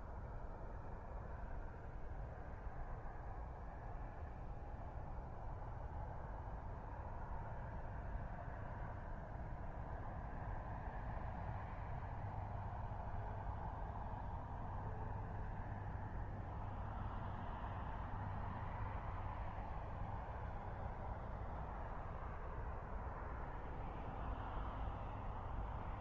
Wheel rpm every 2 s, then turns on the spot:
0, 0, 0, 0, 0, 0, 0, 0, 0, 0, 0, 0, 0.
none